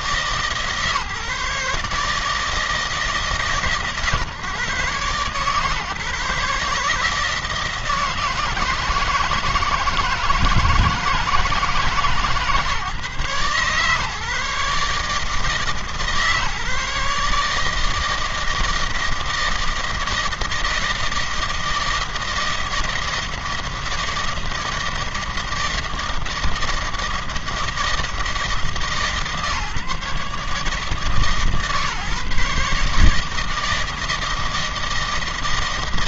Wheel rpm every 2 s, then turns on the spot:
160, 150, 130, 150, 160, 160, 150, 150, 150, 160, 160, 160, 160, 160, 150, 150, 150, 160.
none